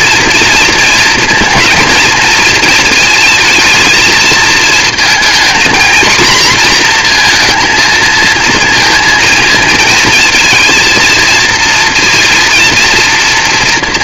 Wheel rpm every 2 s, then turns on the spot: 230, 230, 220, 230, 230, 230, 230.
none